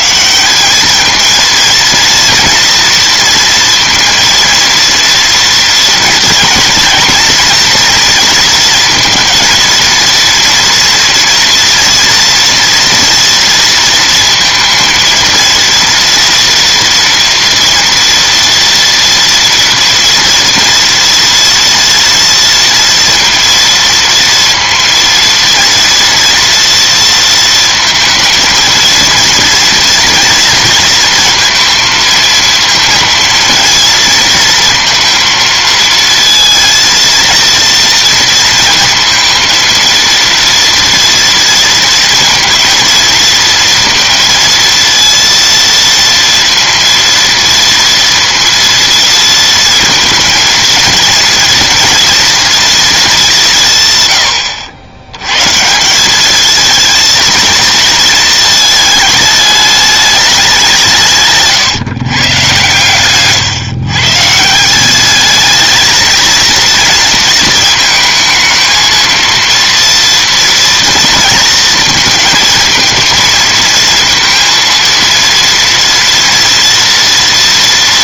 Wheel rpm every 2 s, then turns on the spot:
200, 230, 230, 230, 230, 230, 240, 230, 230, 230, 230, 230, 230, 230, 230, 230, 220, 230, 230, 230, 230, 220, 230, 230, 230, 230, 230, 90, 220, 220, 170, 120, 180, 230, 220, 230, 230, 230, 230.
none